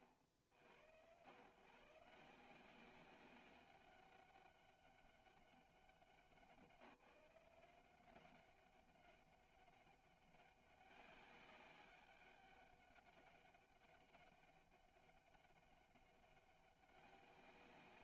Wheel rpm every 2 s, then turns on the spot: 100, 180, 200, 180, 200, 200, 200, 200, 200.
none